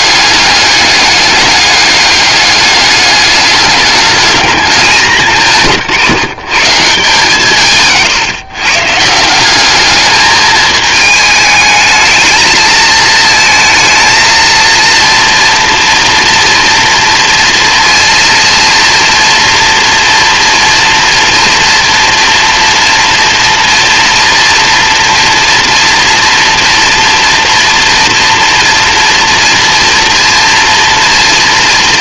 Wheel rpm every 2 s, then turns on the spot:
200, 210, 180, 160, 150, 210, 230, 230, 230, 230, 230, 230, 230, 230, 230, 230.
none